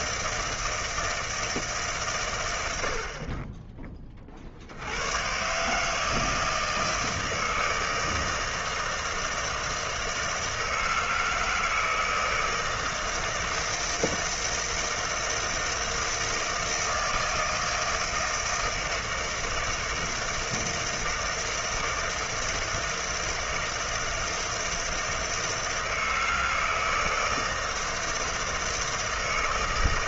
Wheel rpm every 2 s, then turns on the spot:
160, 90, 60, 160, 160, 160, 160, 160, 160, 160, 160, 160, 160, 160, 160.
none